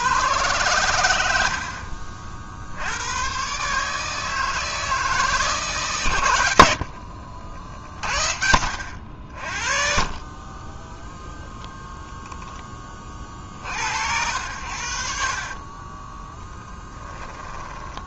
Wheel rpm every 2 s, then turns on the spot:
100, 80, 160, 70, 80, 40, 20, 80, 10.
6-10